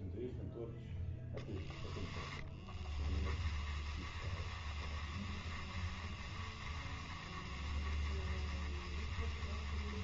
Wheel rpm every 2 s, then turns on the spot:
0, 10, 20, 20, 20.
2-10